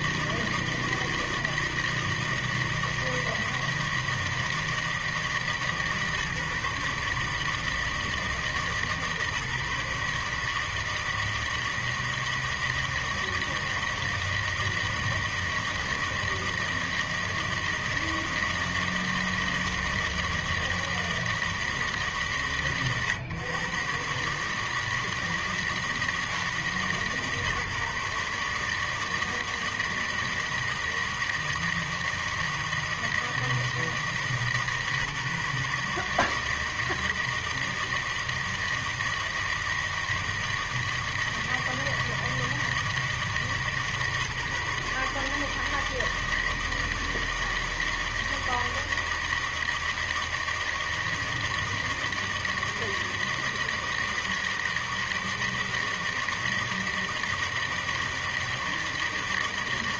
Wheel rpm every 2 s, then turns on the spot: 160, 160, 160, 150, 160, 150, 160, 160, 160, 160, 160, 140, 140, 160, 140, 160, 160, 160, 150, 160, 160, 160, 150, 160, 160, 160, 160, 160, 160, 160.
none